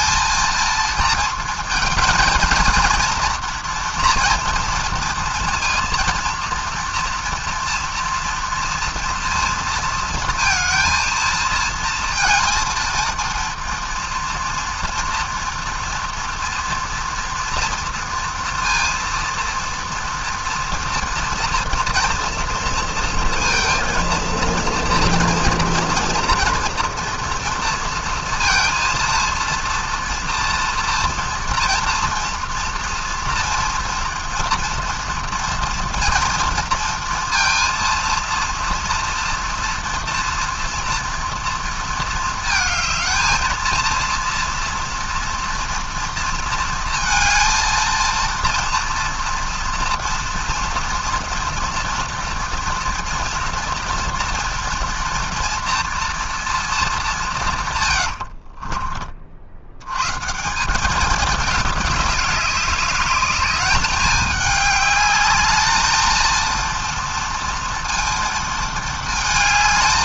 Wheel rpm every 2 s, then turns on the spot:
220, 230, 230, 230, 230, 230, 220, 230, 240, 230, 230, 230, 230, 230, 230, 230, 230, 230, 230, 230, 230, 220, 230, 230, 230, 240, 240, 240, 230, 40, 190, 200, 210, 230, 230.
58-60